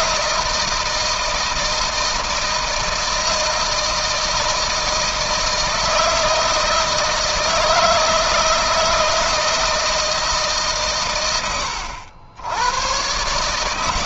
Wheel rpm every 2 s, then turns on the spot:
160, 160, 160, 160, 160, 150, 90.
none